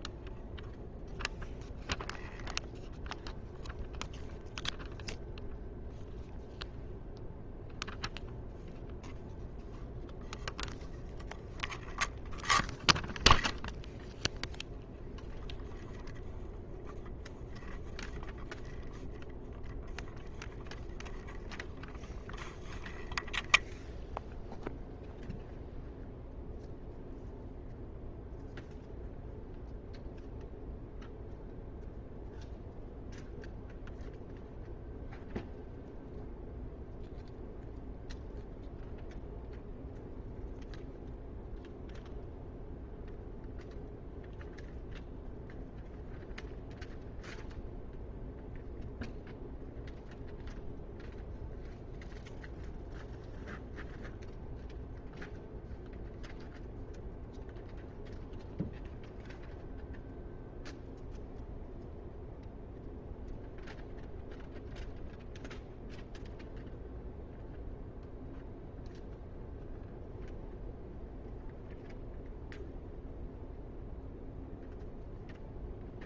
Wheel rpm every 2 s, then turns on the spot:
0, 0, 0, 0, 0, 0, 0, 0, 0, 0, 0, 0, 0, 0, 0, 0, 0, 0, 0, 0, 0, 0, 0, 0, 0, 0, 0, 0, 0, 0, 0, 0, 0, 0, 0, 0, 0, 0.
none